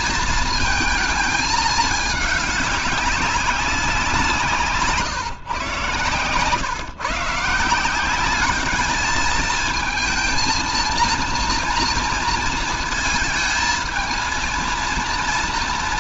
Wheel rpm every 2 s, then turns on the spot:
230, 200, 170, 140, 210, 230, 230, 230.
none